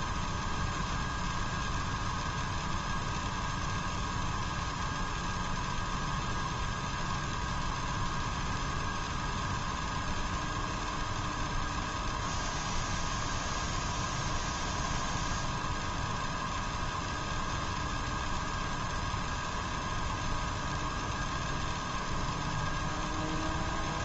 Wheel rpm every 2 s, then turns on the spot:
0, 0, 0, 0, 0, 0, 0, 0, 0, 0, 0, 0.
none